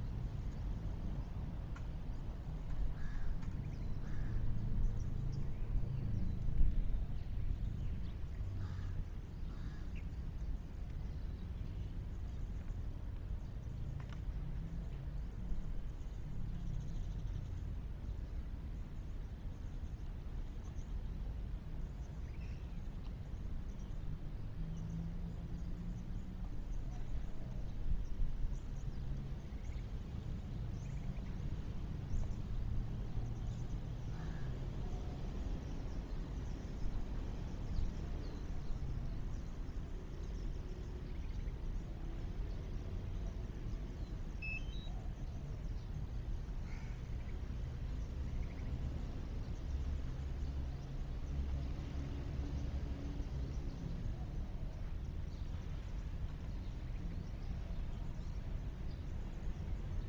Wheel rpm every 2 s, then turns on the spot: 0, 0, 0, 0, 0, 0, 0, 0, 0, 0, 0, 0, 0, 0, 0, 0, 0, 0, 0, 0, 0, 0, 0, 0, 0, 0, 0, 0, 0, 0.
none